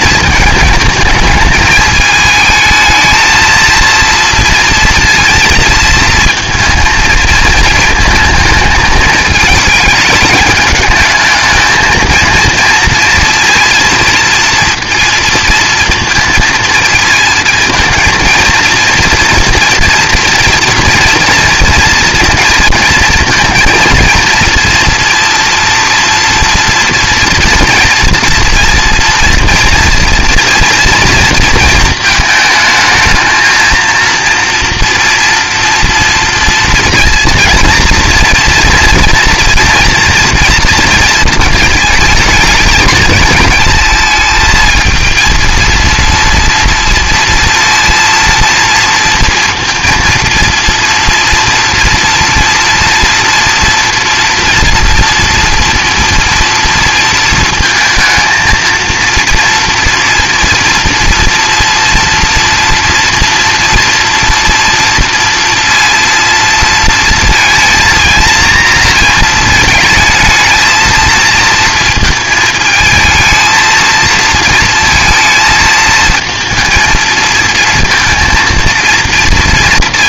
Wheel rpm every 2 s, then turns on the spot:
220, 220, 230, 230, 220, 210, 230, 230, 230, 230, 230, 230, 240, 230, 230, 230, 220, 230, 240, 230, 230, 220, 220, 230, 230, 230, 230, 230, 230, 230, 230, 230, 230, 230, 230, 220, 220, 230, 220, 230.
none